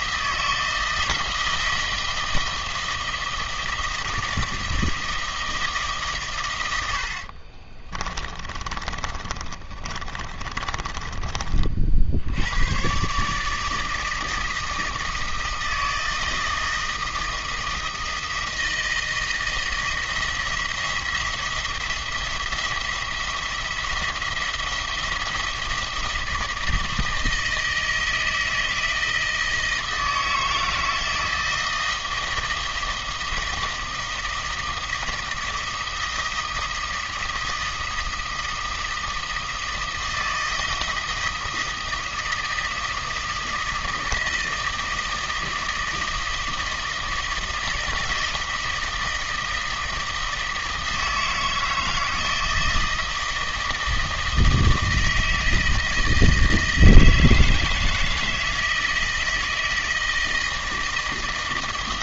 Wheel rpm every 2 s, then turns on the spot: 160, 160, 160, 100, 30, 30, 100, 160, 160, 160, 170, 170, 170, 160, 160, 160, 160, 160, 160, 160, 160, 160, 160, 160, 160, 160, 160, 160, 160, 160, 160.
8-12